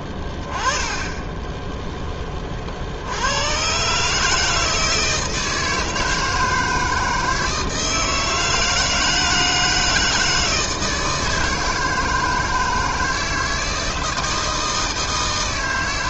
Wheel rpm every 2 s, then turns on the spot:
20, 40, 160, 160, 160, 160, 160, 160.
none